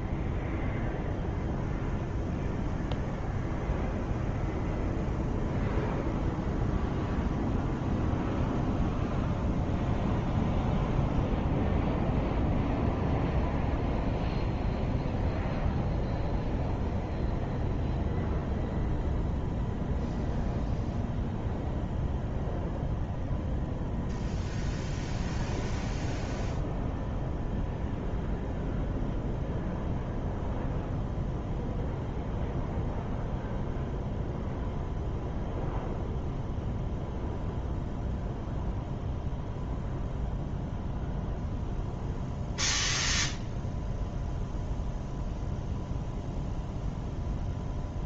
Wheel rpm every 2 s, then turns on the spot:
0, 0, 0, 0, 0, 0, 0, 0, 0, 0, 0, 0, 0, 0, 0, 0, 0, 0, 0, 0, 0, 0, 0, 0.
none